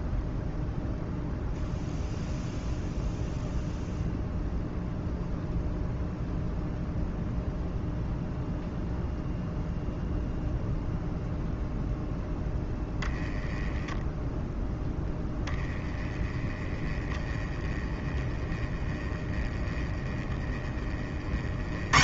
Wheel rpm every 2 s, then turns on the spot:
0, 0, 0, 0, 0, 0, 0, 0, 10, 10, 20.
none